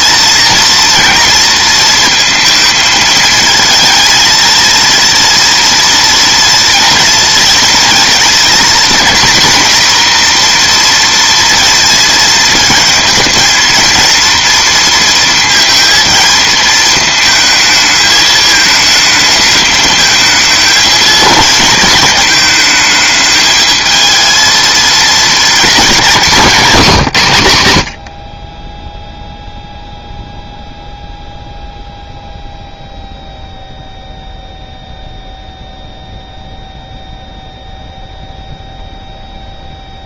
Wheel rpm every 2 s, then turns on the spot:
230, 220, 230, 230, 240, 240, 230, 230, 220, 220, 220, 210, 220, 180, 20, 0, 0, 0, 0, 0.
26-28